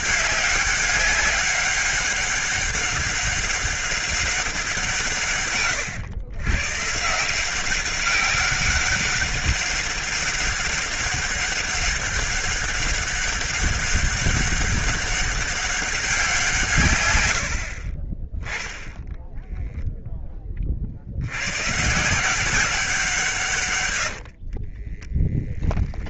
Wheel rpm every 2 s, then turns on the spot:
200, 200, 180, 140, 200, 200, 200, 200, 130, 10, 40, 190, 30.
24-26